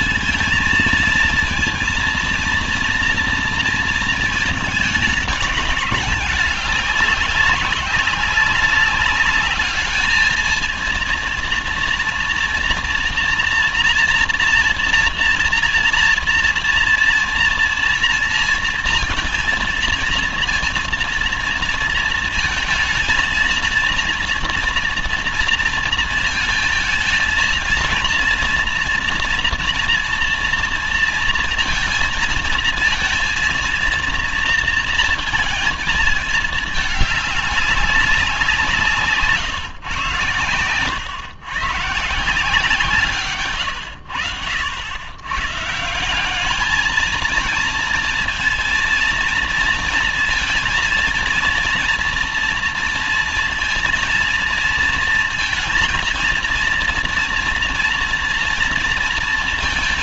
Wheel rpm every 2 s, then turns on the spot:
230, 230, 220, 200, 190, 220, 230, 230, 230, 230, 230, 230, 230, 220, 230, 230, 230, 230, 210, 170, 120, 160, 100, 210, 230, 230, 230, 230, 230, 230.
none